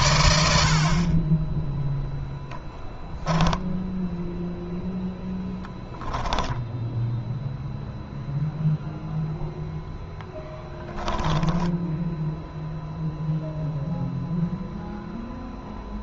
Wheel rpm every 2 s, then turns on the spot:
50, 10, 0, 0, 0, 10, 0, 0.
none